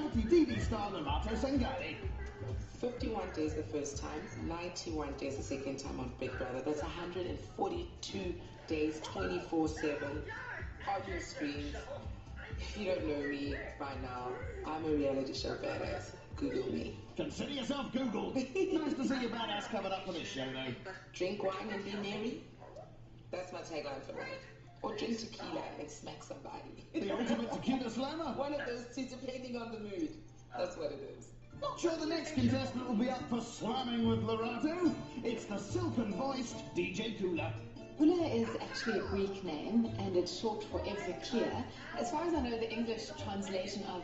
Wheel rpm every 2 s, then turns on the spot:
0, 0, 0, 0, 0, 0, 0, 0, 0, 0, 0, 0, 0, 0, 0, 0, 0, 0, 0, 0, 0, 0.
none